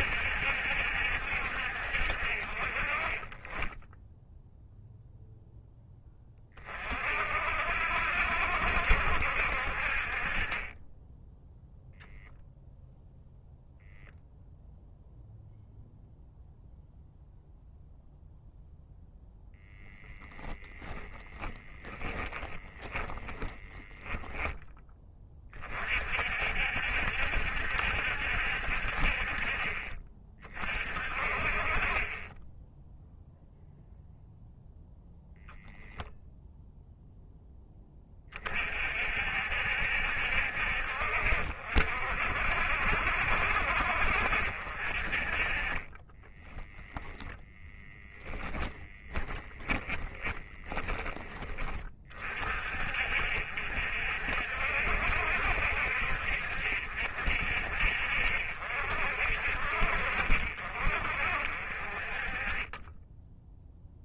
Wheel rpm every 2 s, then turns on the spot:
70, 30, 0, 40, 70, 20, 0, 0, 0, 0, 10, 20, 20, 70, 50, 30, 0, 0, 0, 50, 60, 60, 40, 10, 20, 10, 50, 60, 60, 50, 50, 20.
20-24 46-50